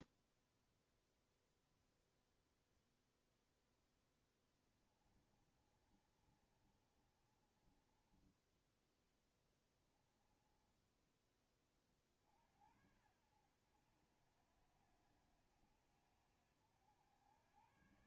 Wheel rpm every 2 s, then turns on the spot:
0, 0, 30, 30, 10, 10, 70, 60, 80.
4-10